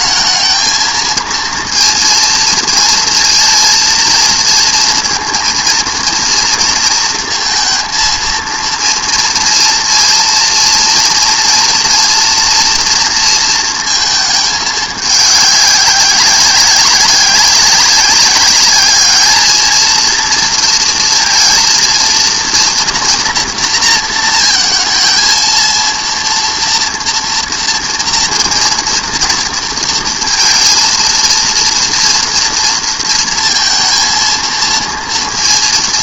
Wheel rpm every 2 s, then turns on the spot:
220, 230, 230, 230, 230, 230, 230, 210, 190, 200, 230, 230, 230, 230, 240, 230, 230, 230.
none